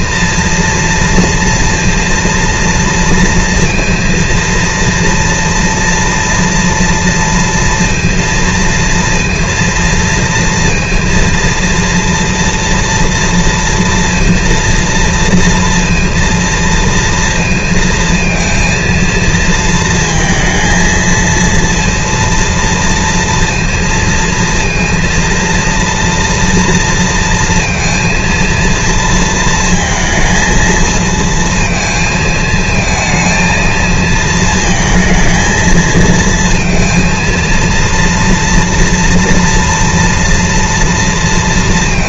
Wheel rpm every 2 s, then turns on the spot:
230, 230, 230, 240, 230, 230, 230, 230, 230, 230, 230, 230, 230, 230, 230, 220, 220, 230, 230, 230, 230.
none